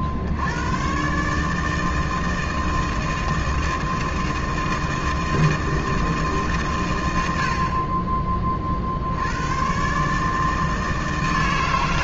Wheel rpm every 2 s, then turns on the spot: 80, 160, 160, 160, 40, 160.
none